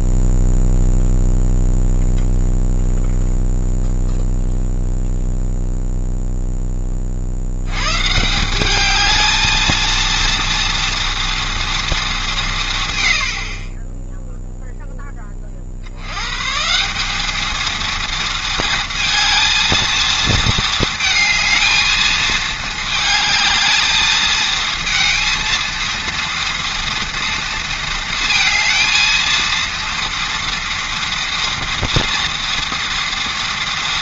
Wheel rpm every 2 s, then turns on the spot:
0, 0, 0, 20, 200, 230, 140, 0, 170, 230, 220, 220, 230, 230, 230, 230, 230.
none